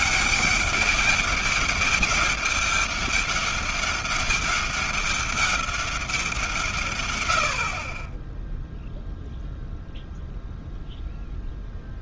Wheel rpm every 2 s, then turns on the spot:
200, 200, 200, 160, 10, 0.
none